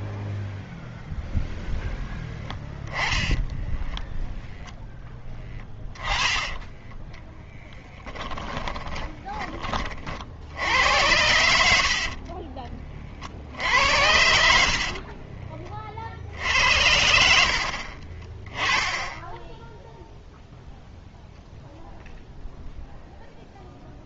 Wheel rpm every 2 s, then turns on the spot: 0, 10, 10, 20, 10, 80, 30, 50, 70, 20, 0, 0.
2-4 8-10